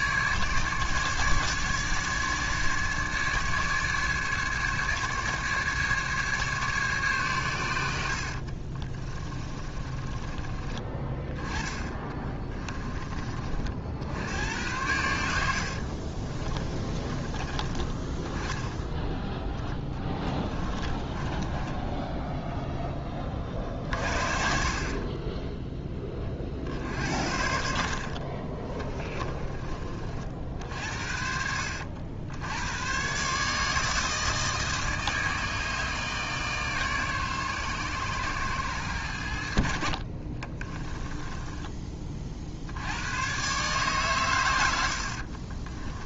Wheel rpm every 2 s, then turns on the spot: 150, 150, 150, 140, 40, 20, 30, 90, 20, 10, 20, 10, 40, 50, 30, 60, 100, 160, 150, 110, 30, 70, 90.
8-10 16-18 20-22 26-30 40-42